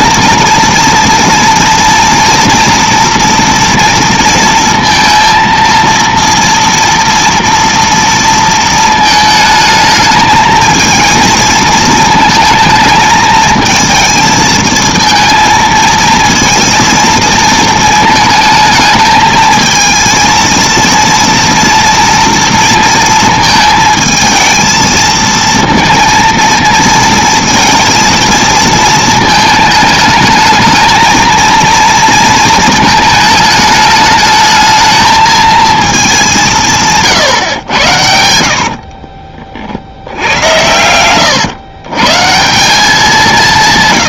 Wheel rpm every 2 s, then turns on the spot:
230, 230, 230, 230, 220, 230, 220, 230, 220, 220, 230, 220, 230, 230, 220, 230, 220, 220, 110, 50, 120, 140.
none